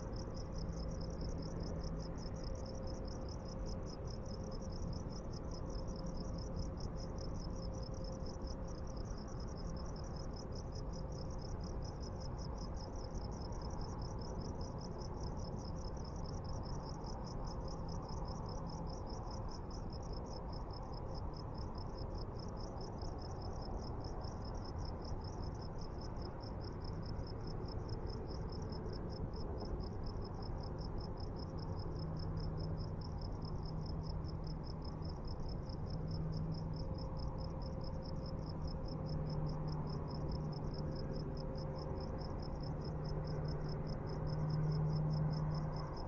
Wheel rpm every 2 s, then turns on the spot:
0, 0, 0, 0, 0, 0, 0, 0, 0, 0, 0, 0, 0, 0, 0, 0, 0, 0, 0, 0, 0, 0, 0.
none